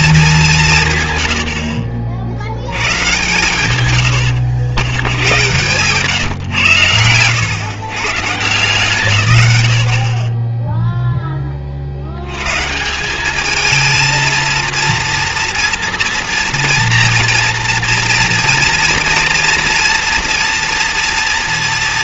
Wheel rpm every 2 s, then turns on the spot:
180, 80, 110, 120, 150, 30, 120, 230, 230, 230, 240.
none